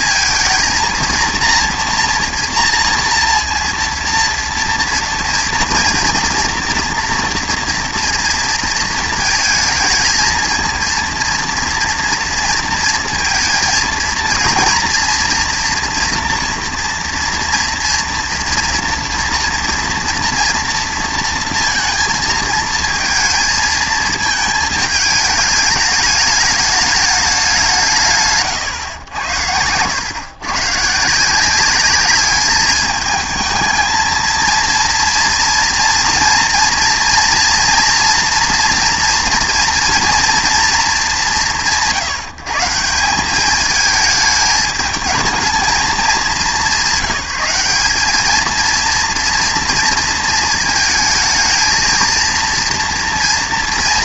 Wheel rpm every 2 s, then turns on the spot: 230, 230, 230, 230, 230, 230, 230, 230, 230, 230, 230, 220, 220, 210, 110, 140, 210, 230, 230, 230, 200, 170, 210, 200, 230, 220, 230.
none